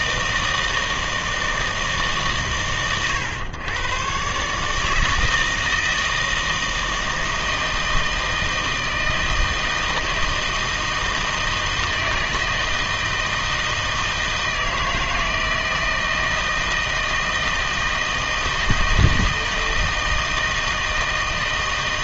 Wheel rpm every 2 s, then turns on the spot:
160, 130, 150, 160, 160, 160, 160, 160, 160, 160, 160.
none